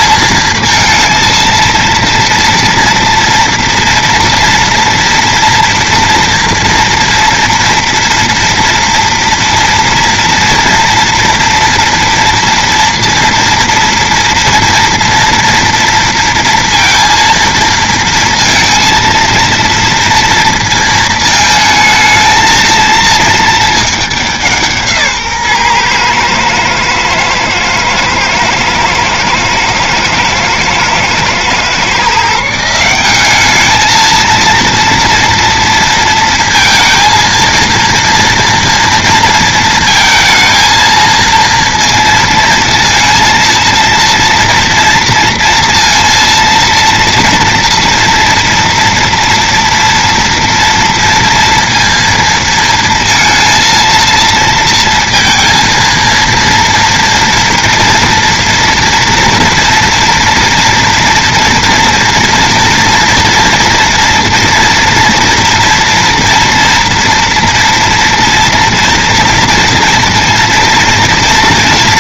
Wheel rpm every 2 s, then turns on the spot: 230, 230, 230, 230, 230, 240, 230, 230, 230, 230, 230, 220, 160, 110, 110, 110, 170, 230, 230, 230, 220, 230, 230, 230, 230, 230, 230, 230, 230, 230, 230, 230, 230, 230, 240, 240.
none